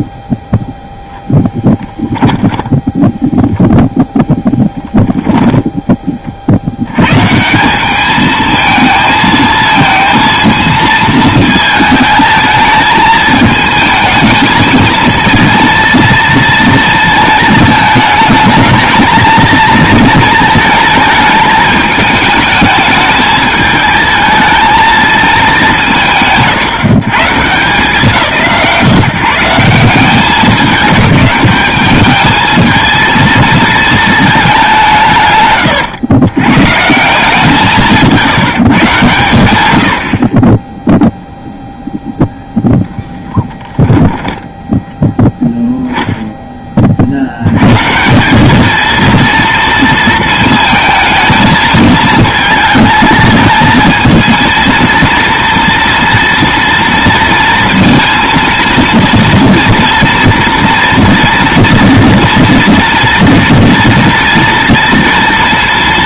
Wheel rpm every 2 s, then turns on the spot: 0, 10, 10, 80, 220, 230, 220, 220, 230, 210, 220, 220, 220, 180, 140, 200, 220, 190, 140, 140, 20, 0, 0, 10, 200, 220, 220, 230, 230, 230, 230, 230, 240.
4-6